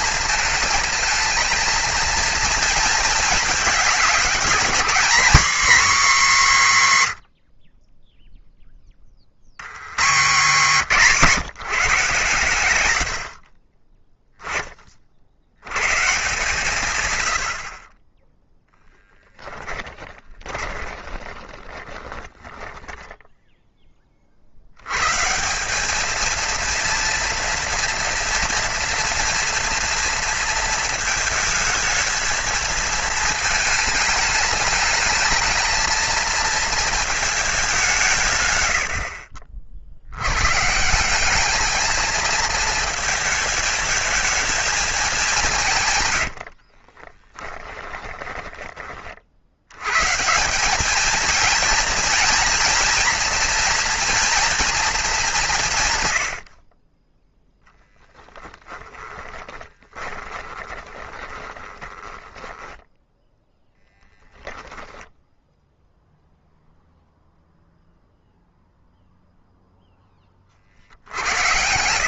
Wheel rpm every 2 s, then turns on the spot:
220, 230, 230, 160, 20, 180, 90, 40, 120, 0, 20, 10, 100, 230, 230, 230, 220, 210, 220, 90, 160, 220, 210, 40, 30, 210, 230, 220, 30, 10, 20, 10, 0, 0, 0, 60.
20-24 46-48 58-62 70-72